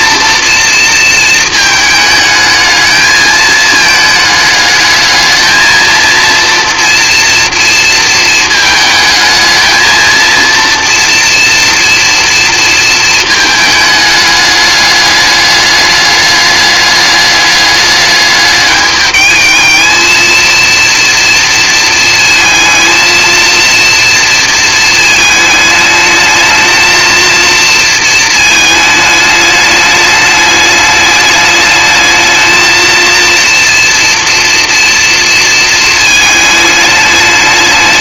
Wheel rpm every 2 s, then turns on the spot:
230, 220, 210, 240, 220, 240, 220, 210, 210, 210, 230, 230, 220, 220, 220, 210, 230, 230, 210.
none